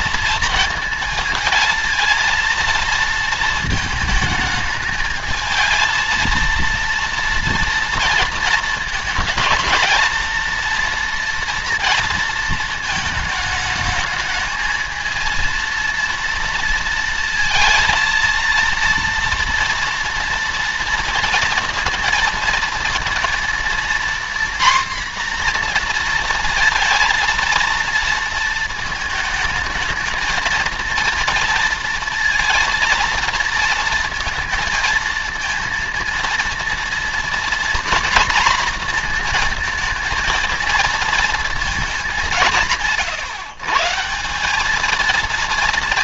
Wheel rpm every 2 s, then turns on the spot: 230, 230, 220, 230, 230, 230, 230, 220, 230, 230, 230, 230, 250, 230, 230, 220, 230, 230, 230, 240, 230, 180, 180.
none